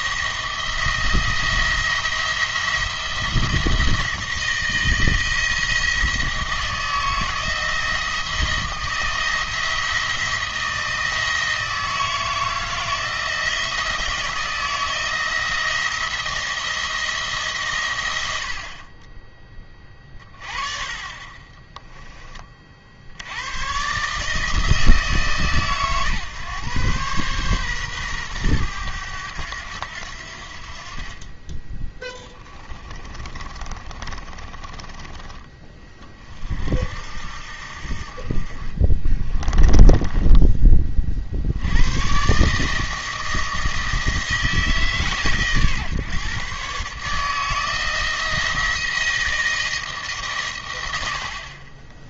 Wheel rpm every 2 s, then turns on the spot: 170, 170, 170, 160, 160, 160, 160, 160, 170, 50, 30, 30, 160, 130, 110, 60, 20, 30, 50, 40, 20, 150, 160, 140, 170, 120.
32-36